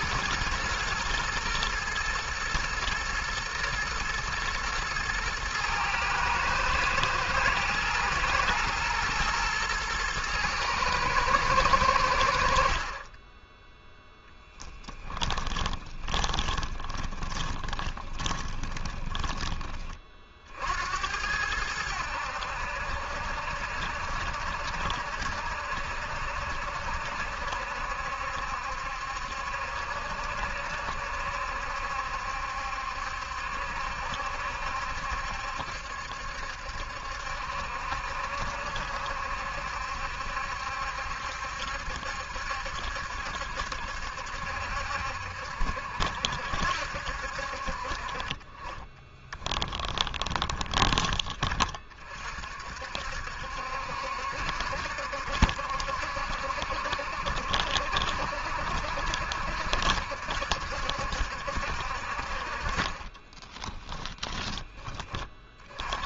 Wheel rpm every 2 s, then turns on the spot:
110, 110, 110, 110, 120, 110, 50, 10, 20, 20, 60, 70, 70, 70, 70, 70, 70, 70, 70, 70, 70, 70, 70, 70, 20, 20, 50, 70, 70, 70, 70, 40, 20.
14-20 48-50